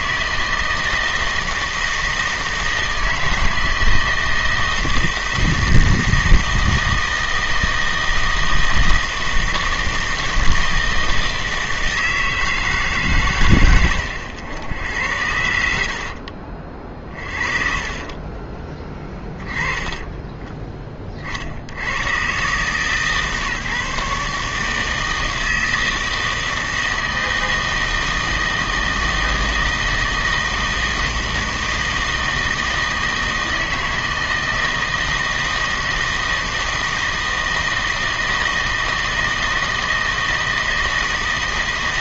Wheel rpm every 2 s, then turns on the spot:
160, 160, 160, 160, 160, 160, 150, 90, 40, 20, 20, 140, 150, 160, 160, 160, 160, 160, 160, 160, 160.
18-20